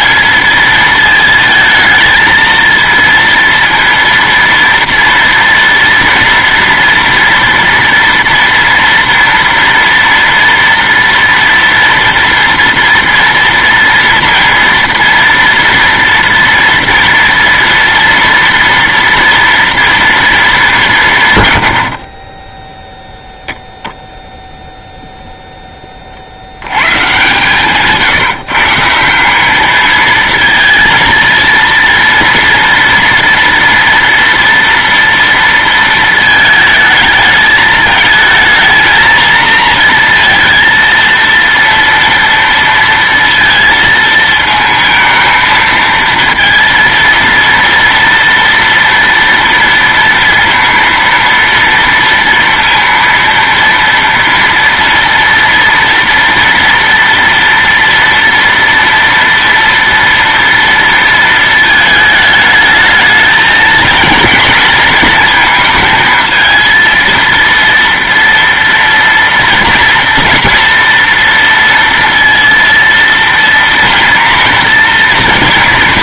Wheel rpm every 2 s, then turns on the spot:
210, 220, 230, 230, 240, 230, 230, 230, 230, 230, 220, 30, 0, 60, 150, 220, 230, 230, 220, 220, 230, 230, 220, 230, 230, 230, 230, 230, 230, 230, 230, 220, 230, 230, 230, 230, 230, 240.
none